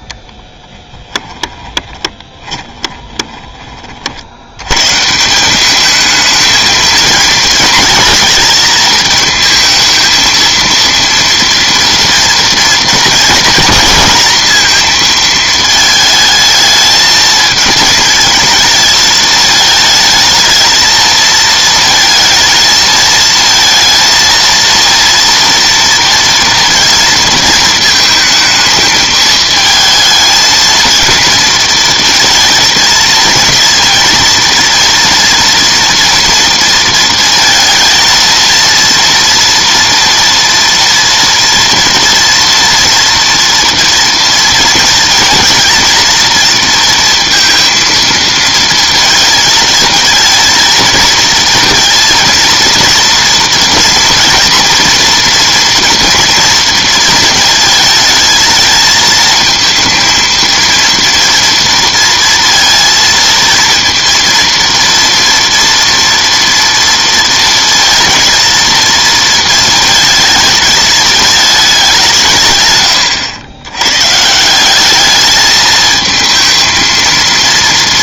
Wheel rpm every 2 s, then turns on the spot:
10, 20, 90, 220, 230, 230, 230, 230, 220, 220, 220, 220, 230, 230, 220, 230, 230, 230, 230, 230, 230, 230, 230, 230, 220, 230, 230, 230, 230, 220, 230, 230, 230, 230, 230, 220, 130, 170, 220.
2-4